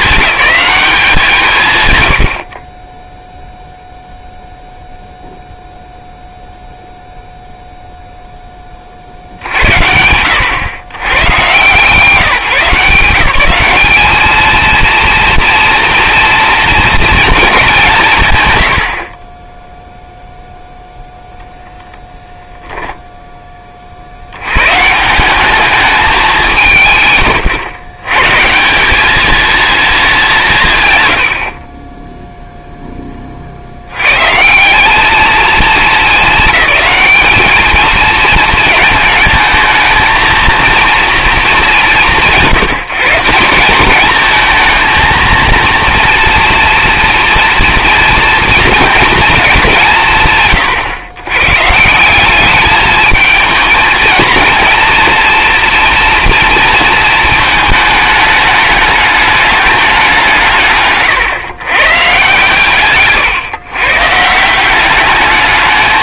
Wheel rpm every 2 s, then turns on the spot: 190, 30, 0, 0, 30, 100, 160, 220, 230, 100, 0, 0, 110, 200, 150, 150, 0, 170, 210, 220, 230, 180, 220, 240, 230, 140, 200, 230, 230, 210, 160, 150, 170.
none